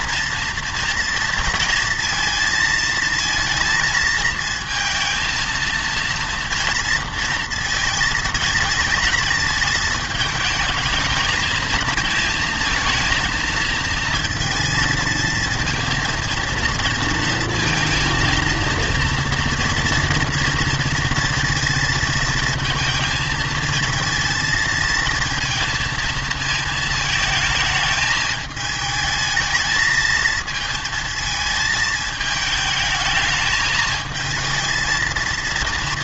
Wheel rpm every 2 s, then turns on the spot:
230, 230, 230, 240, 230, 220, 220, 230, 230, 230, 230, 230, 220, 220, 220, 230, 220, 220.
none